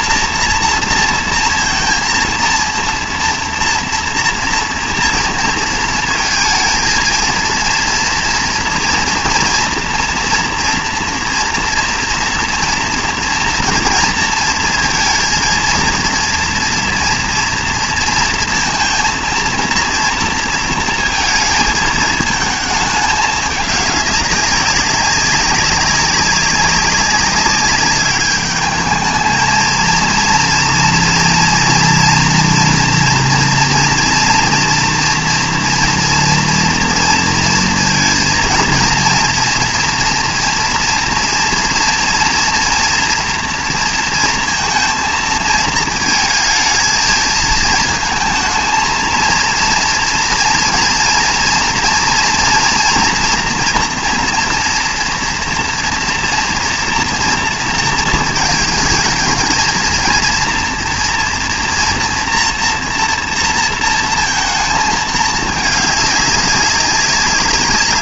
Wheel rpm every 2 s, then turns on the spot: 240, 230, 230, 230, 240, 230, 230, 230, 230, 230, 230, 220, 200, 200, 210, 230, 230, 230, 230, 230, 230, 230, 230, 220, 220, 230, 240, 230, 230, 220, 230, 230, 230, 200.
none